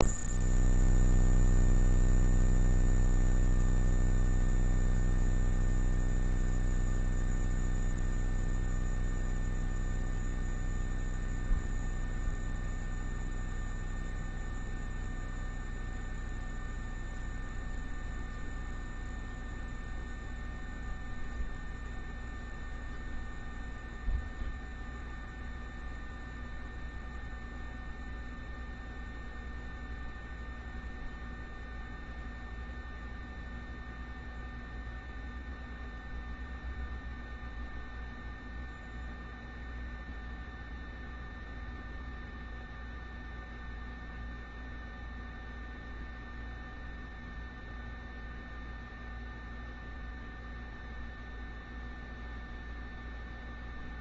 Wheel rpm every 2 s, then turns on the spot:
0, 0, 0, 0, 0, 0, 0, 0, 0, 0, 0, 0, 0, 0, 0, 0, 0, 0, 0, 0, 0, 0, 0, 0, 0, 0, 0.
none